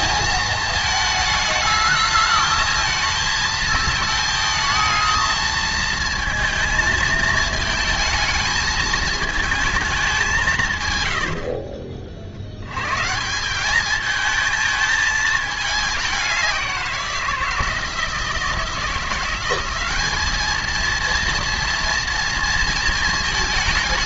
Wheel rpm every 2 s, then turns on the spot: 220, 220, 220, 220, 220, 150, 80, 220, 190, 160, 220, 230.
none